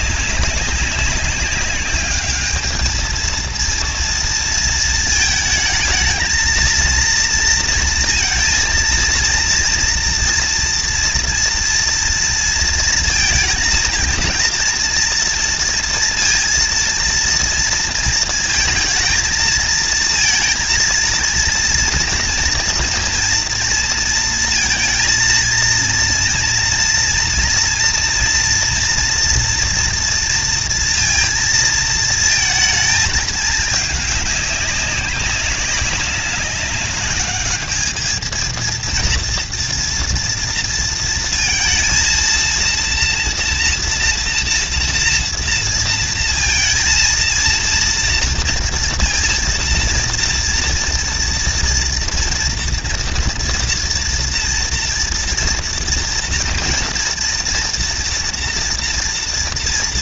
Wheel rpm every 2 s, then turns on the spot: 200, 220, 220, 220, 230, 240, 230, 230, 230, 230, 230, 230, 230, 230, 230, 230, 220, 200, 200, 230, 230, 230, 230, 230, 230, 230, 230, 230, 230, 230.
none